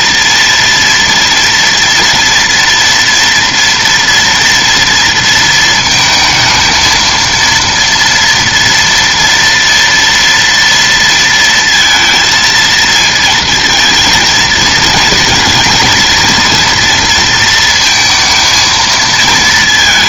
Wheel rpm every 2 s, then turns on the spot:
230, 230, 230, 220, 230, 230, 220, 230, 240, 230.
none